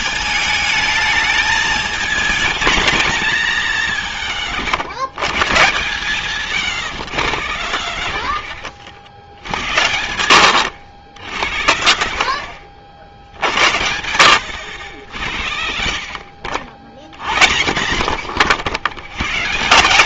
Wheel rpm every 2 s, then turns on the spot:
210, 220, 160, 150, 70, 100, 80, 100, 60, 120.
6-10